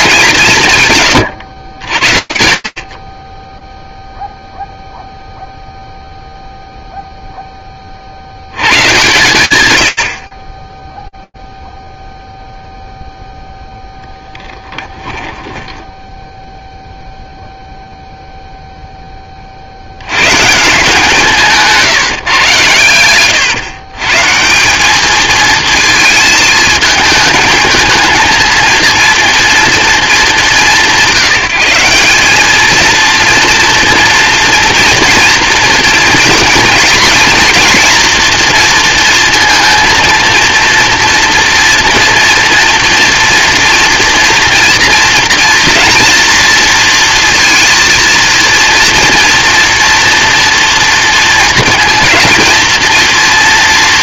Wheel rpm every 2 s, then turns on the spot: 200, 80, 0, 0, 100, 30, 0, 10, 0, 20, 170, 120, 220, 220, 230, 180, 230, 230, 240, 230, 230, 230, 230, 230, 230, 230, 210.
14-16 20-22